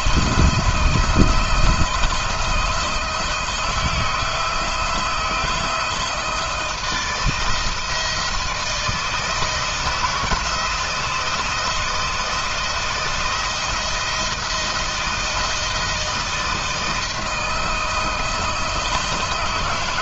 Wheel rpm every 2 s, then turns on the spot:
170, 160, 170, 170, 160, 160, 170, 170, 160, 160.
none